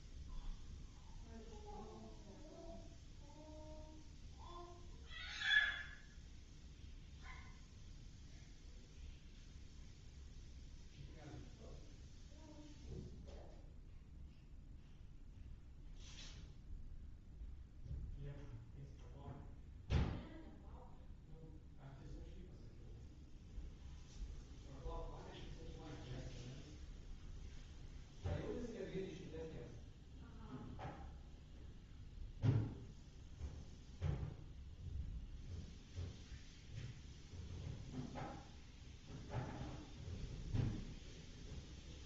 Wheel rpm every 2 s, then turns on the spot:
0, 0, 0, 0, 0, 0, 0, 0, 0, 0, 0, 0, 0, 0, 0, 0, 0, 0, 0, 0, 0.
none